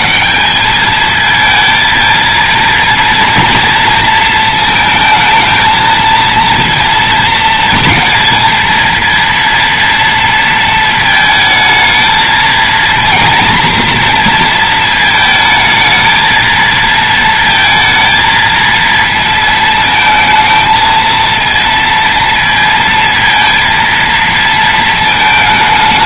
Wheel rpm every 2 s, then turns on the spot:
210, 230, 220, 230, 230, 220, 230, 230, 230, 230, 230, 230, 220.
none